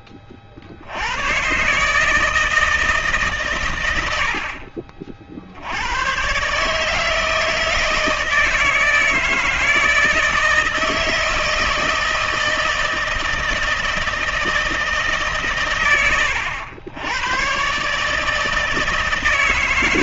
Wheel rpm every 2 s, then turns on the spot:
60, 160, 50, 140, 160, 160, 160, 160, 100, 150.
none